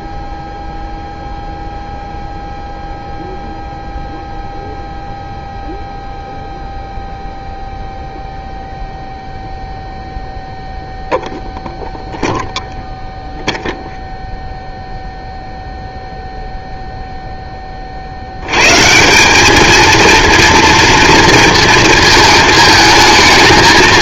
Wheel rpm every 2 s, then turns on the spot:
0, 0, 0, 0, 0, 0, 0, 0, 0, 120, 230, 220.
none